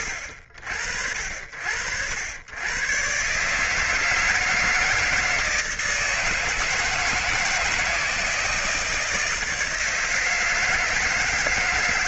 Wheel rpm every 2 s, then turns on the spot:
70, 100, 160, 160, 160, 160.
none